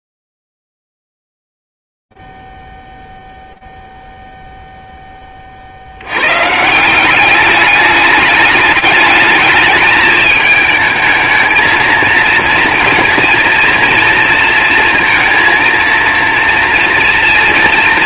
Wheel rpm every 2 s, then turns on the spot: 0, 0, 0, 50, 200, 210, 220, 230, 230.
none